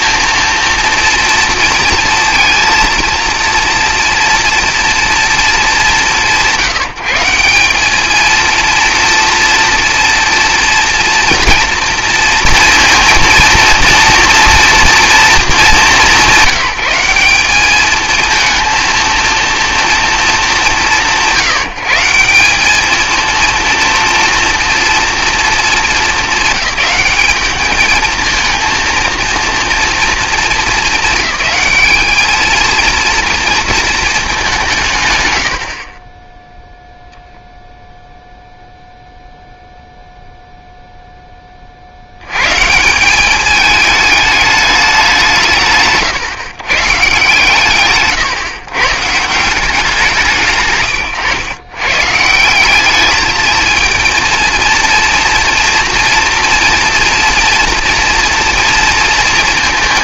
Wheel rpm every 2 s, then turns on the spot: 230, 230, 230, 170, 240, 230, 230, 230, 200, 230, 160, 210, 230, 200, 230, 210, 230, 200, 0, 0, 0, 170, 200, 130, 140, 110, 200, 230, 230, 230.
none